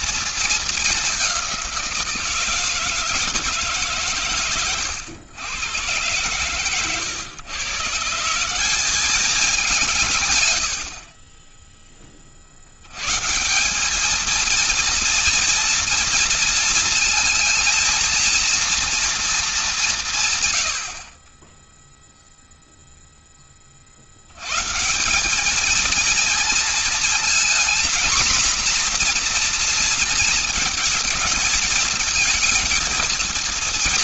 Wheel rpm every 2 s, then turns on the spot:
220, 160, 110, 130, 190, 70, 80, 230, 230, 230, 80, 0, 150, 230, 240, 220, 230.
none